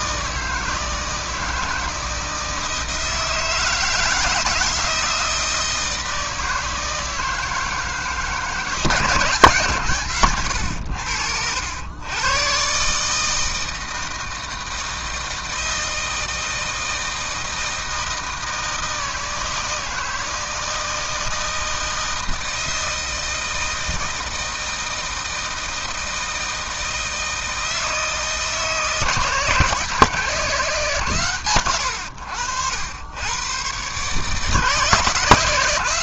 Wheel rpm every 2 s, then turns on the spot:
160, 160, 160, 160, 150, 80, 140, 160, 160, 160, 160, 160, 160, 160, 160, 140, 90, 160.
none